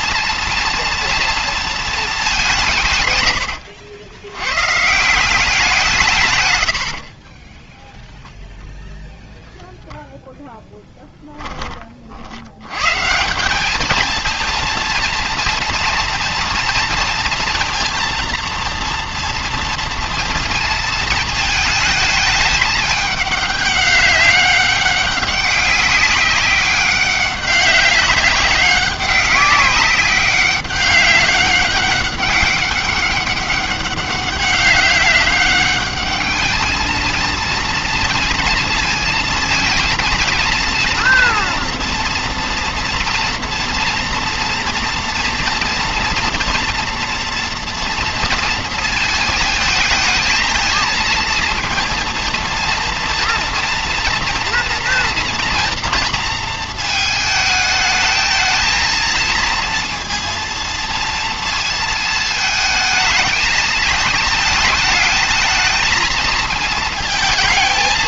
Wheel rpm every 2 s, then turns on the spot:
230, 160, 120, 100, 0, 0, 100, 230, 230, 230, 230, 210, 200, 200, 190, 200, 200, 190, 220, 230, 230, 230, 230, 240, 230, 220, 230, 230, 230, 220, 230, 220, 220, 220.
6-8